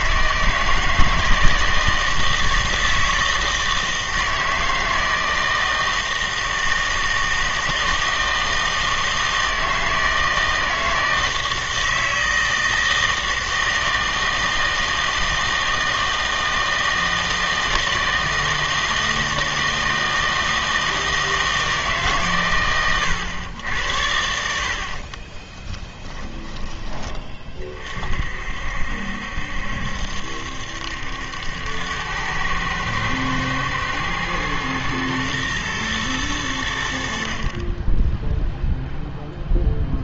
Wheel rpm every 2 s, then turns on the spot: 160, 160, 160, 160, 160, 160, 160, 160, 160, 160, 160, 120, 60, 10, 60, 70, 110, 120, 80, 0.
24-26